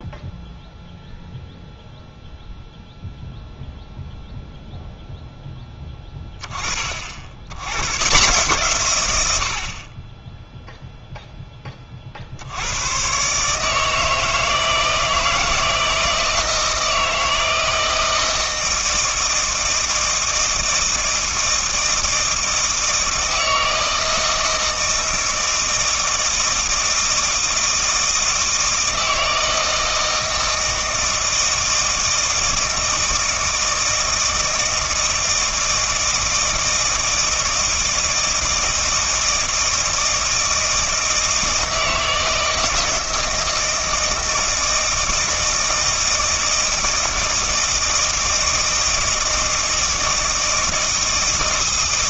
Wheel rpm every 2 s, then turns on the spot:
0, 0, 0, 30, 130, 0, 90, 160, 160, 160, 160, 160, 160, 160, 160, 160, 160, 160, 160, 160, 160, 160, 160, 160, 160, 160.
none